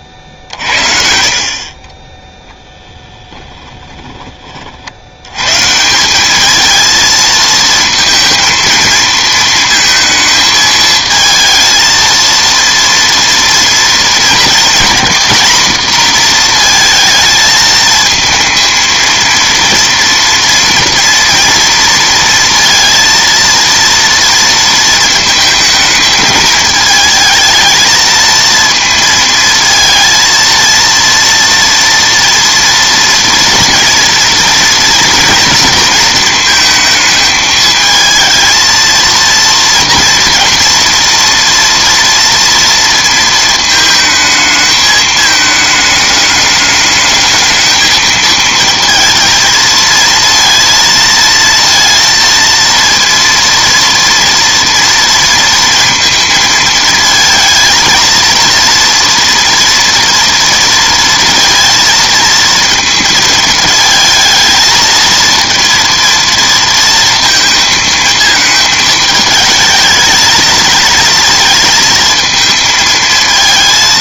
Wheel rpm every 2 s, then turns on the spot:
50, 10, 50, 220, 230, 220, 230, 230, 230, 230, 230, 230, 230, 220, 230, 230, 230, 220, 220, 230, 230, 230, 220, 210, 230, 230, 230, 230, 220, 230, 230, 220, 230, 230, 220, 230, 220.
none